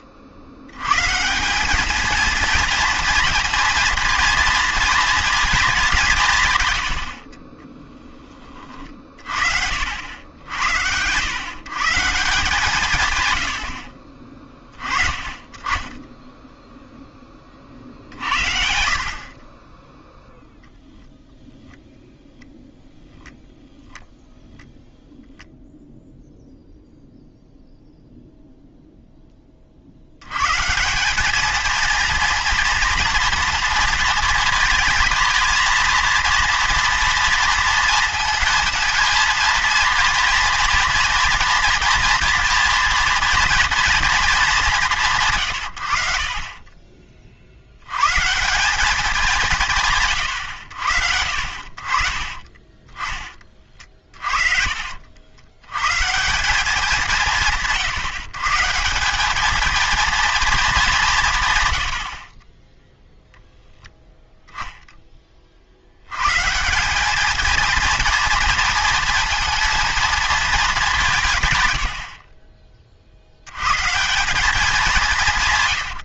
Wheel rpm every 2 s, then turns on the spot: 80, 230, 230, 120, 30, 90, 160, 30, 10, 60, 0, 0, 0, 0, 0, 150, 240, 230, 230, 230, 230, 230, 200, 30, 180, 100, 30, 50, 190, 160, 220, 20, 0, 160, 230, 210, 40, 190.
54-56